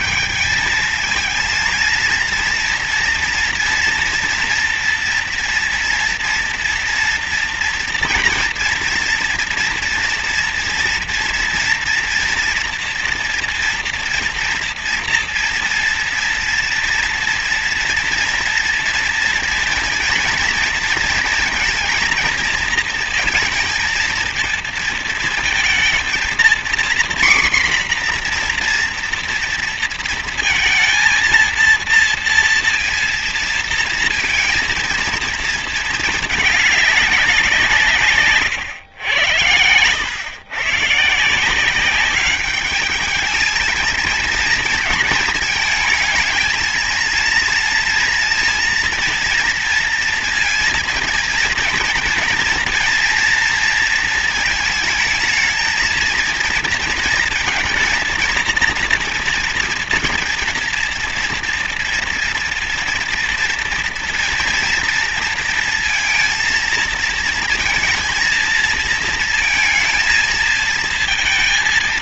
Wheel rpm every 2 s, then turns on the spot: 220, 230, 230, 230, 230, 230, 240, 230, 230, 230, 230, 220, 230, 250, 240, 230, 230, 230, 210, 120, 140, 210, 230, 220, 230, 230, 230, 220, 230, 230, 230, 240, 230, 230, 230, 230.
none